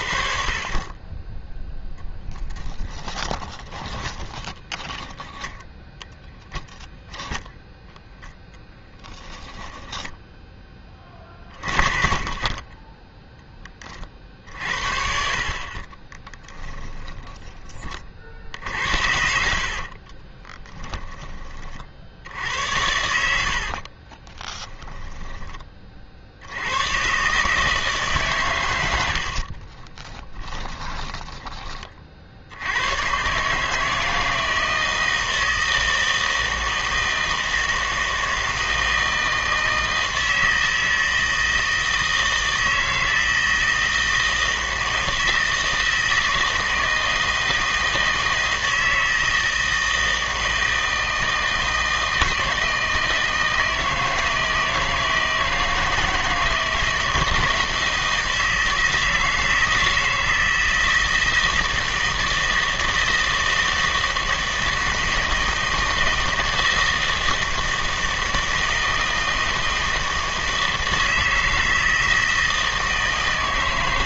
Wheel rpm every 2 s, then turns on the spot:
40, 10, 10, 0, 0, 20, 10, 60, 10, 50, 10, 80, 20, 100, 110, 10, 80, 160, 160, 160, 160, 160, 160, 160, 160, 160, 160, 160, 160, 160, 160, 160, 160, 160, 160, 160, 160.
2-6 16-22 24-26 30-32